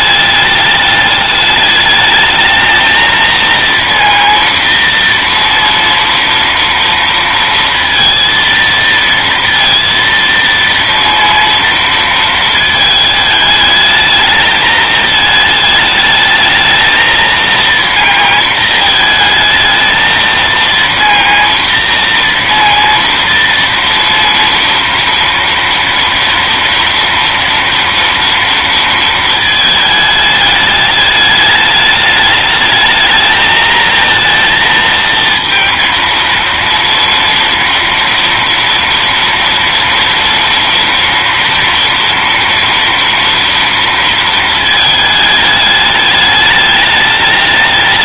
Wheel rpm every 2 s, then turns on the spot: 210, 220, 230, 230, 230, 230, 220, 220, 220, 220, 230, 230, 240, 230, 230, 210, 220, 230, 230, 230, 230, 230, 220, 210.
none